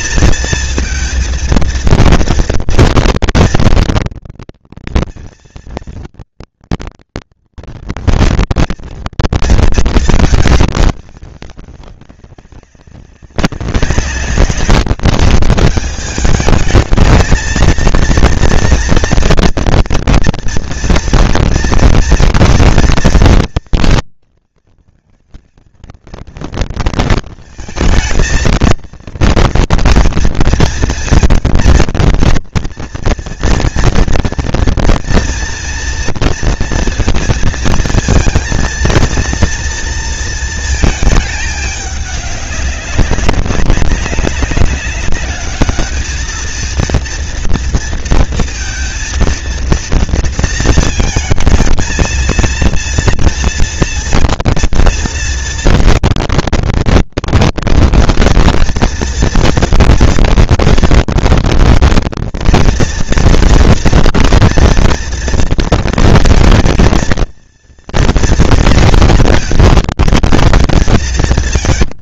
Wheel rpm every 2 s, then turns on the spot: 230, 230, 230, 230, 230, 220, 190, 200, 220, 230, 240, 240, 230, 230, 220, 230, 230, 230, 230, 230, 230, 200, 200, 220, 230, 230, 230, 230, 230, 230, 230, 230, 230, 230, 230, 230.
none